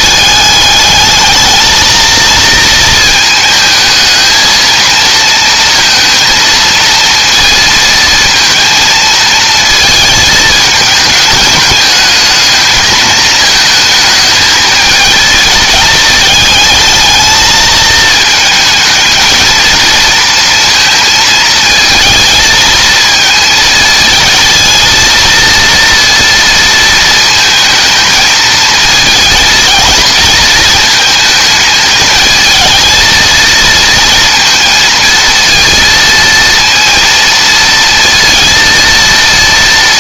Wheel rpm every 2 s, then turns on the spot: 210, 220, 220, 230, 230, 220, 220, 220, 220, 220, 230, 220, 230, 230, 220, 230, 220, 230, 230, 230.
none